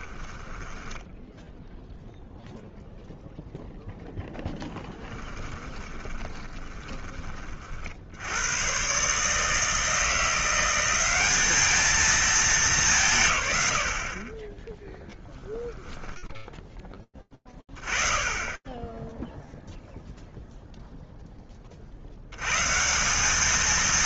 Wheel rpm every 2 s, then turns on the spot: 0, 10, 20, 90, 170, 220, 40, 10, 20, 0, 90, 230.
4-6